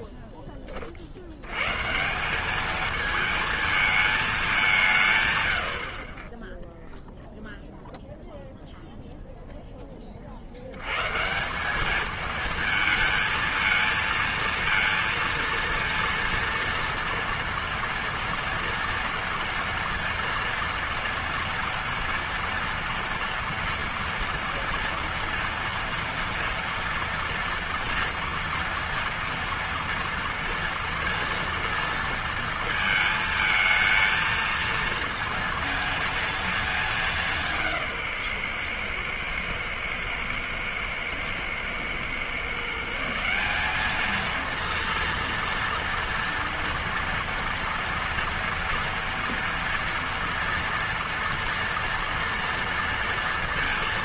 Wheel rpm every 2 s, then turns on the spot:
30, 220, 160, 0, 0, 80, 220, 230, 230, 230, 230, 230, 230, 230, 230, 230, 220, 230, 220, 130, 120, 150, 230, 230, 230, 240, 230.
none